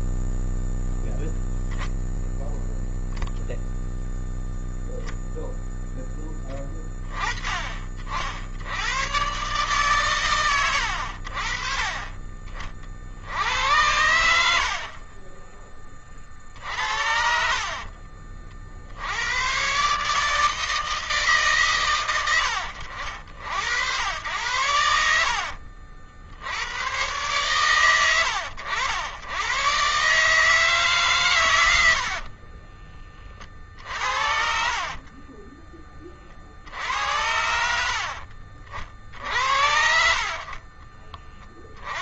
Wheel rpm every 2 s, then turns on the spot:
0, 0, 0, 20, 100, 90, 50, 60, 50, 70, 160, 60, 80, 110, 90, 140, 20, 40, 70, 60, 20.
16-18 34-36 40-42